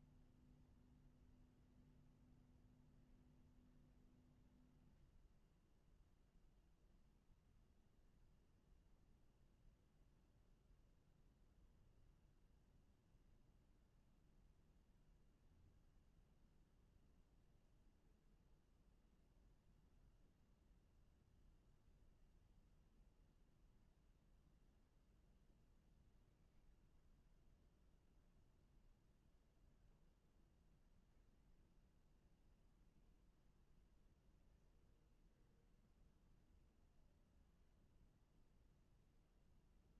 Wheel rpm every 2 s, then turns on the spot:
0, 0, 0, 0, 0, 0, 0, 0, 0, 0, 0, 0, 0, 0, 0, 0, 0, 0, 0, 0.
none